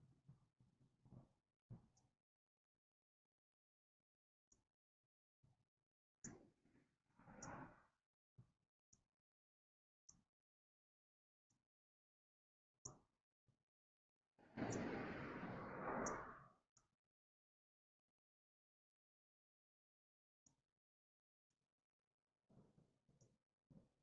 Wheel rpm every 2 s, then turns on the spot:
0, 0, 0, 0, 0, 0, 0, 0, 0, 0, 0, 0.
none